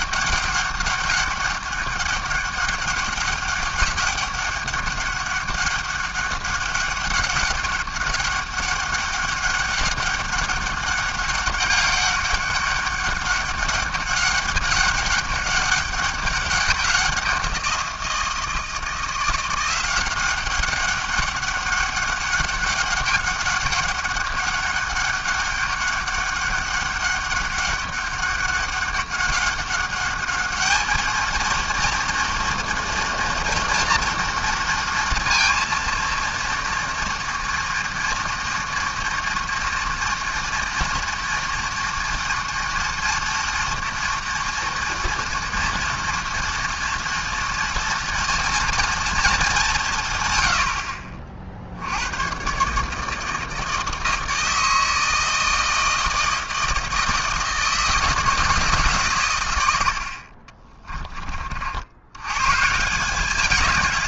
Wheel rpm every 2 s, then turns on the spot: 200, 200, 200, 200, 200, 200, 200, 200, 190, 170, 190, 200, 200, 200, 200, 210, 230, 230, 230, 230, 230, 230, 230, 230, 230, 90, 140, 160, 160, 160, 30, 140.
60-62